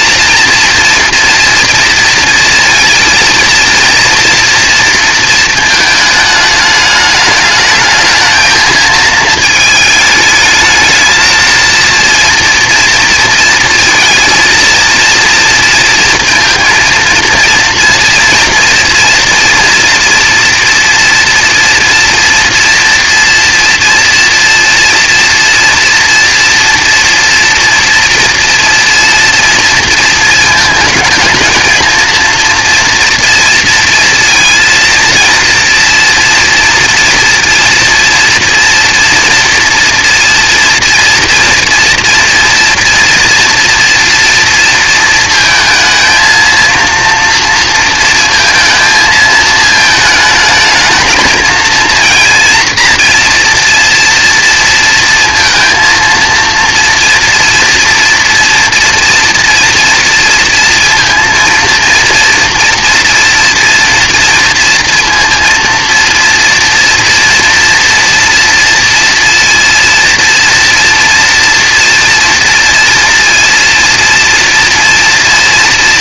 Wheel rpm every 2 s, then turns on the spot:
240, 230, 230, 210, 220, 220, 230, 230, 230, 230, 240, 230, 230, 230, 230, 220, 230, 230, 230, 240, 230, 230, 230, 230, 230, 220, 230, 230, 230, 230, 230, 230, 230, 230, 230, 230, 230, 230.
none